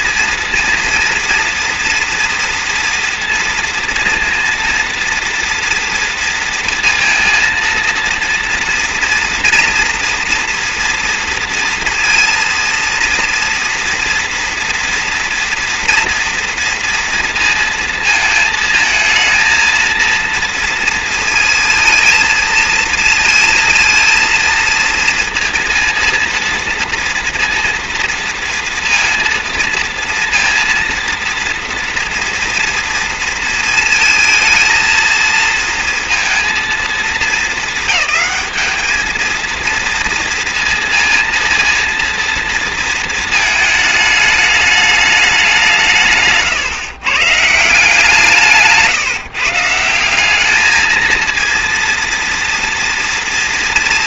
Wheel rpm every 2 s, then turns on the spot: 230, 230, 230, 230, 230, 240, 230, 230, 230, 220, 230, 230, 230, 230, 230, 230, 230, 230, 230, 210, 230, 230, 210, 150, 170, 200, 230.
none